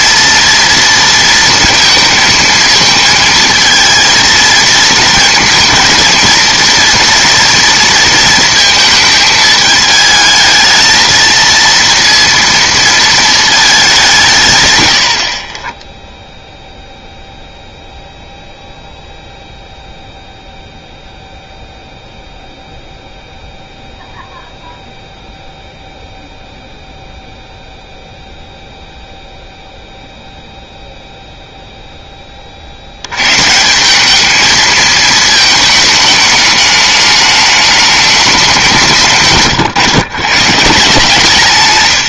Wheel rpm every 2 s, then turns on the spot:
230, 220, 230, 230, 220, 220, 230, 130, 0, 0, 0, 0, 0, 0, 0, 0, 50, 220, 210, 190, 140.
none